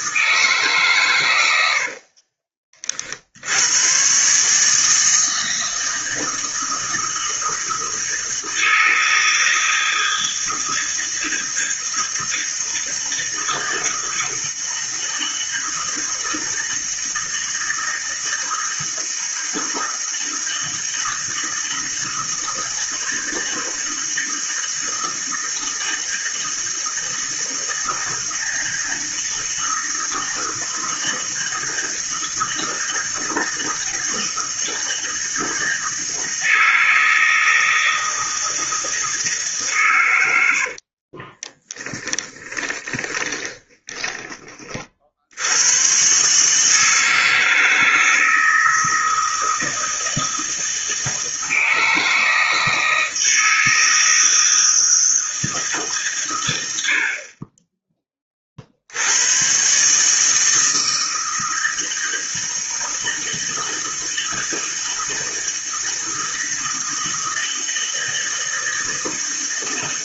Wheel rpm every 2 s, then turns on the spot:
140, 40, 150, 160, 160, 160, 160, 160, 160, 160, 160, 160, 160, 160, 160, 160, 160, 160, 160, 160, 60, 20, 40, 150, 160, 160, 160, 160, 80, 60, 160, 160, 160, 160, 160.
40-44